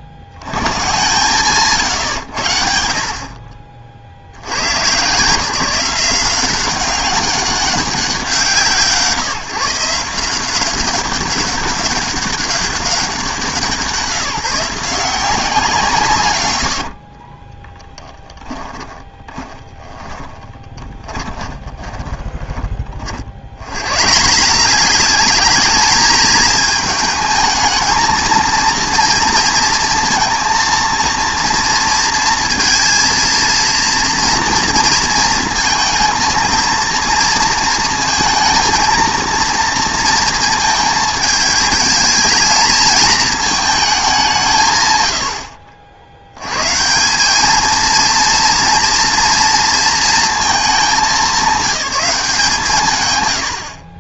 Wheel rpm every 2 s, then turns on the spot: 70, 70, 100, 180, 140, 180, 200, 170, 90, 20, 20, 30, 180, 220, 230, 230, 230, 230, 230, 230, 220, 220, 130, 130, 240, 220, 150.
16-22